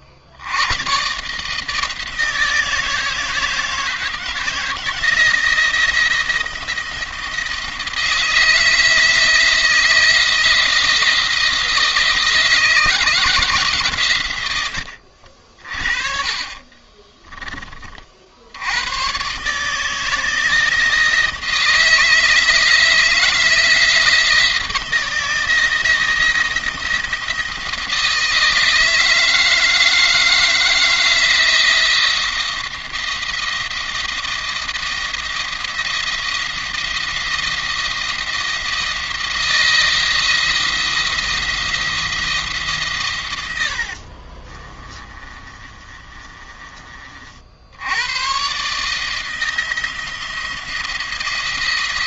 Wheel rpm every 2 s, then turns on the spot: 110, 160, 160, 170, 160, 170, 170, 80, 20, 90, 160, 170, 160, 170, 160, 160, 170, 170, 170, 170, 170, 130, 30, 40, 150, 170.
14-18 44-46